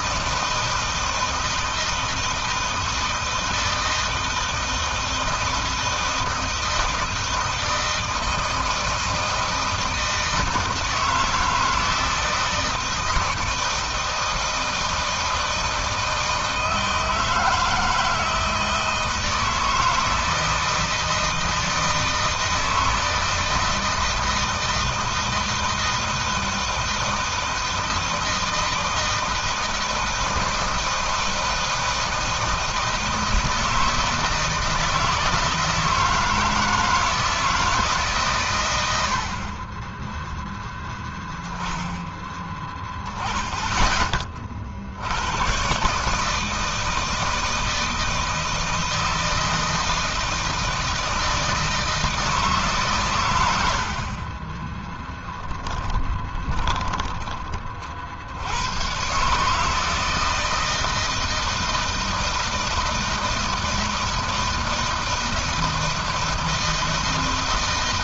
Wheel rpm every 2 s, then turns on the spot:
160, 160, 160, 160, 160, 160, 160, 160, 160, 160, 160, 160, 160, 160, 160, 160, 160, 160, 160, 110, 10, 20, 50, 160, 160, 160, 140, 10, 20, 90, 160, 160, 160, 160.
54-58